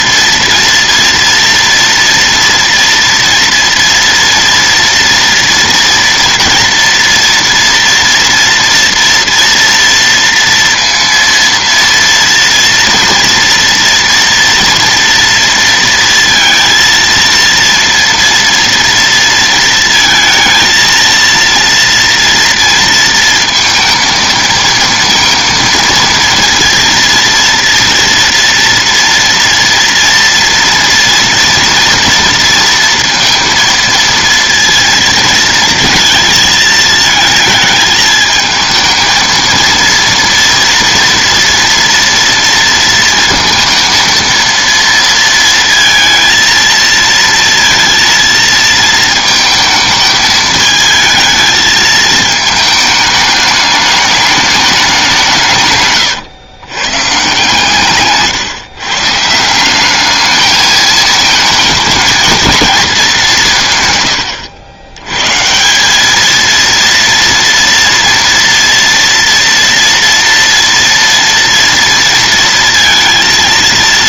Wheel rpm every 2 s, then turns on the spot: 230, 230, 230, 230, 230, 230, 230, 230, 230, 230, 230, 230, 230, 230, 230, 230, 230, 230, 220, 220, 230, 230, 230, 230, 230, 220, 220, 210, 120, 140, 210, 220, 90, 230, 230, 230, 230.
none